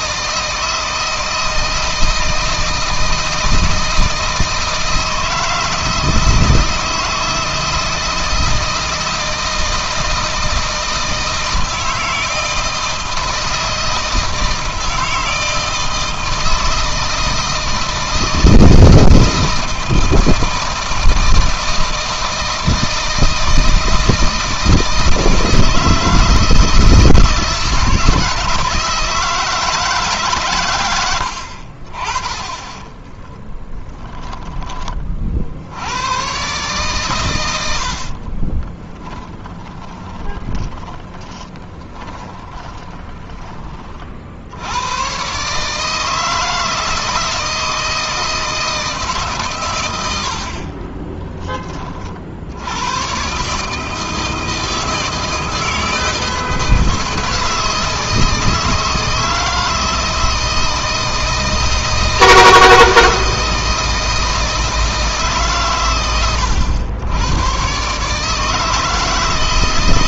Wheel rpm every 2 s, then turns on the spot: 160, 160, 160, 160, 160, 160, 170, 160, 160, 160, 160, 160, 160, 160, 160, 90, 20, 20, 120, 20, 20, 20, 110, 160, 150, 30, 110, 160, 160, 160, 160, 160, 150, 100, 160.
32-34 38-44 50-52